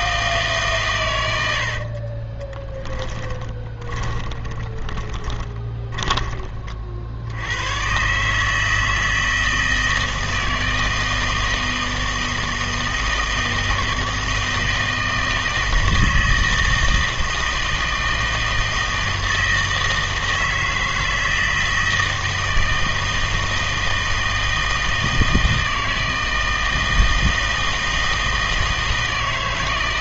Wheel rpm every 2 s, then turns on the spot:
140, 20, 20, 30, 150, 160, 160, 160, 160, 160, 160, 160, 160, 160, 160.
2-6